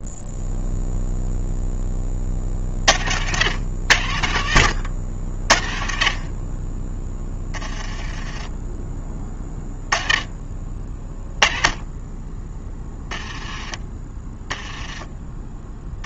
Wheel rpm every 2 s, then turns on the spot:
0, 60, 80, 20, 20, 30, 10, 10.
14-16